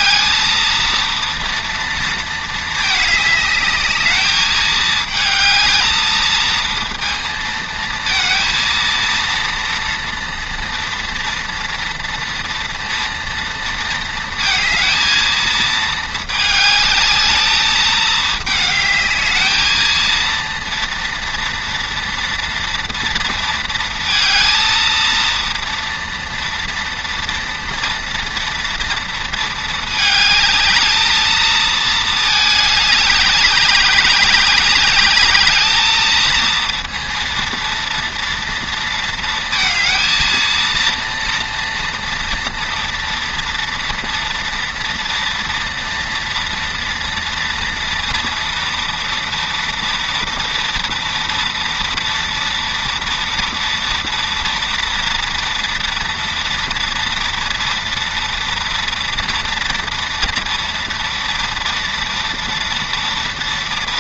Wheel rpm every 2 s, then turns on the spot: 220, 220, 220, 230, 230, 240, 230, 230, 220, 210, 230, 230, 230, 230, 230, 220, 210, 200, 230, 230, 230, 230, 230, 230, 230, 230, 230, 230, 230, 230, 230, 230.
none